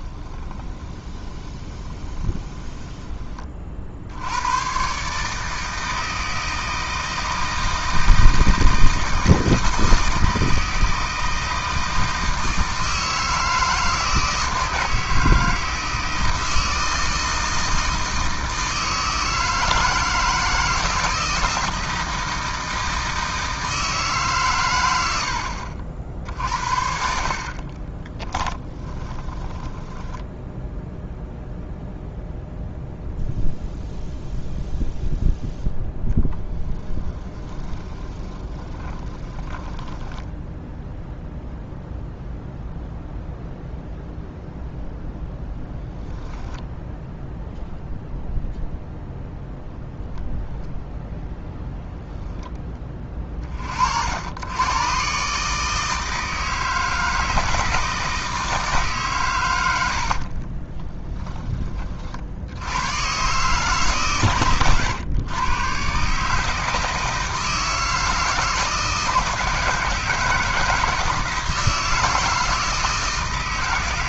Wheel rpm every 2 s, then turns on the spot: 20, 10, 130, 160, 160, 160, 160, 160, 160, 160, 160, 160, 110, 50, 20, 0, 0, 0, 20, 20, 0, 0, 0, 0, 0, 0, 10, 110, 160, 150, 20, 110, 120, 160, 160, 160, 160.
0-4 28-30 36-40 60-62